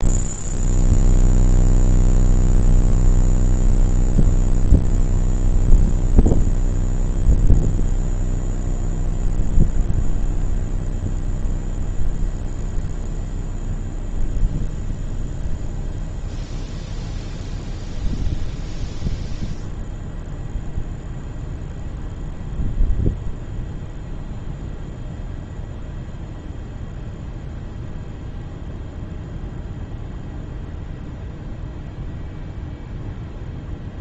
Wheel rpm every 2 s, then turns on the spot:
0, 0, 0, 0, 0, 0, 0, 0, 0, 0, 0, 0, 0, 0, 0, 0, 0.
none